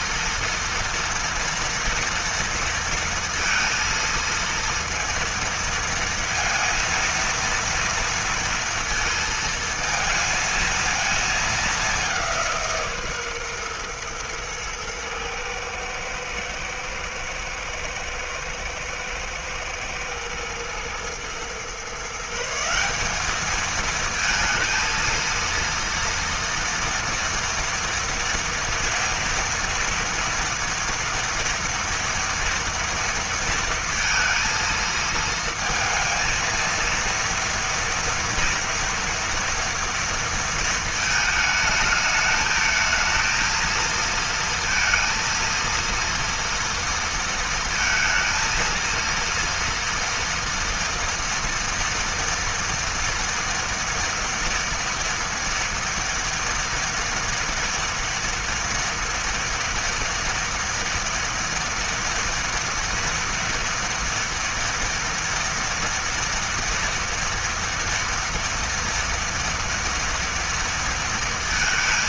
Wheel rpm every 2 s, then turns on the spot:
230, 230, 230, 230, 230, 220, 140, 110, 120, 120, 120, 200, 230, 230, 230, 230, 230, 230, 230, 230, 220, 220, 230, 230, 230, 230, 240, 230, 230, 230, 230, 240, 230, 230, 230, 230.
none